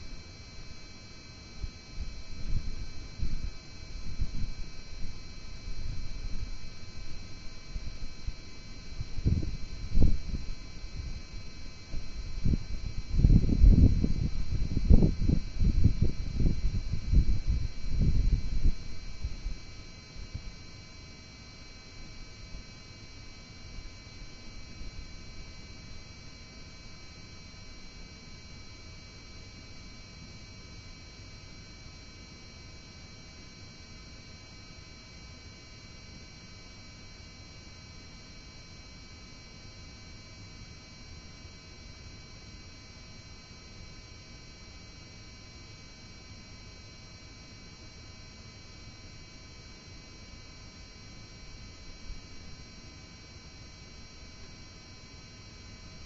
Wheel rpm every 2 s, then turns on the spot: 0, 0, 0, 0, 0, 0, 0, 0, 0, 0, 0, 0, 0, 0, 0, 0, 0, 0, 0, 0, 0, 0, 0, 0, 0, 0, 0, 0.
none